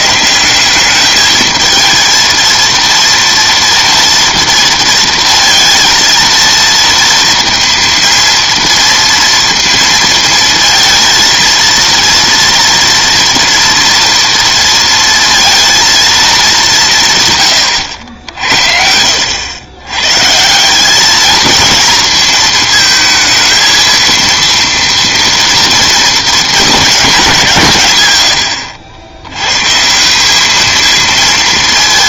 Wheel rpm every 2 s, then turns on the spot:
200, 230, 230, 230, 230, 230, 230, 230, 190, 70, 180, 220, 230, 220, 90, 220.
none